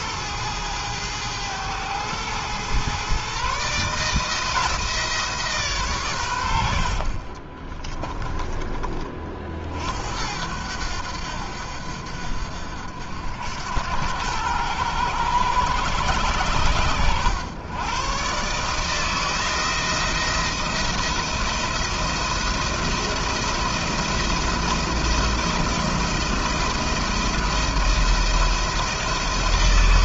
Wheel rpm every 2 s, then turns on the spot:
110, 120, 160, 70, 30, 80, 70, 110, 110, 150, 170, 170, 170, 170, 170.
none